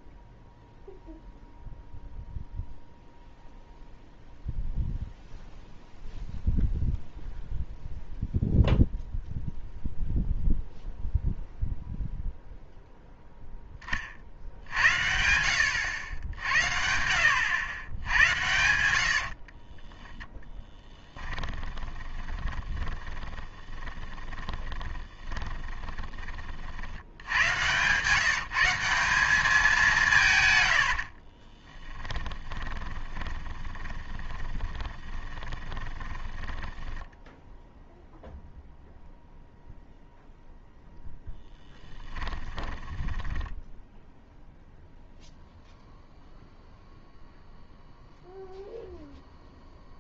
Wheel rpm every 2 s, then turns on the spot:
0, 0, 0, 0, 0, 0, 0, 70, 70, 80, 10, 20, 20, 60, 170, 90, 20, 20, 10, 0, 0, 10, 0, 0, 0.
20-26 30-38 42-44